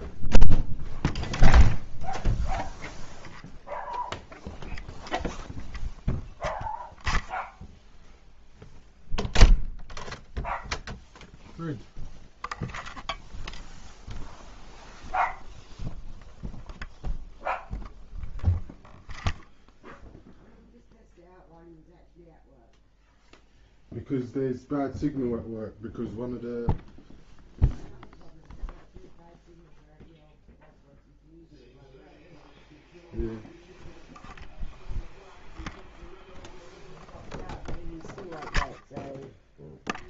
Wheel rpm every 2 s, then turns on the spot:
0, 0, 0, 0, 0, 0, 0, 0, 0, 0, 0, 0, 0, 0, 0, 0, 0, 0, 0, 0.
none